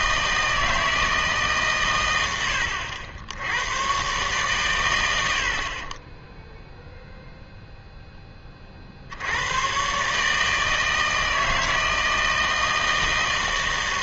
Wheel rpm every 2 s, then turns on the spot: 160, 90, 100, 0, 50, 160, 160.
none